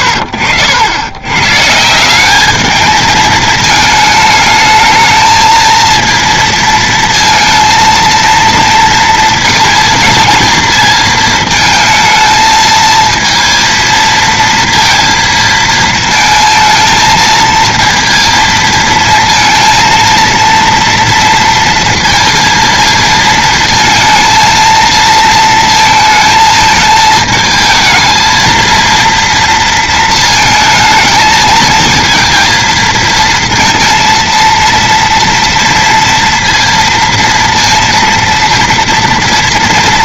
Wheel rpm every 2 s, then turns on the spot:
90, 220, 220, 230, 230, 220, 220, 230, 220, 230, 230, 230, 230, 220, 230, 220, 230, 230, 230, 230.
none